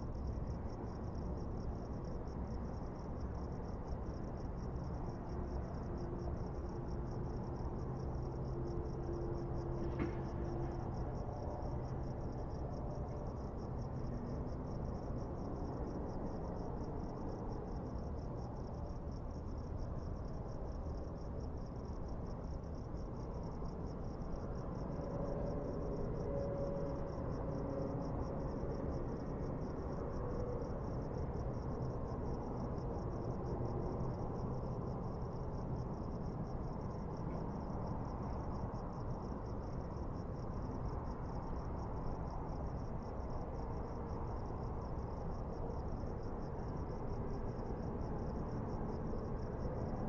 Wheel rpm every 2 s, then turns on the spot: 0, 0, 0, 0, 0, 0, 0, 0, 0, 0, 0, 0, 0, 0, 0, 0, 0, 0, 0, 0, 0, 0, 0, 0, 0.
none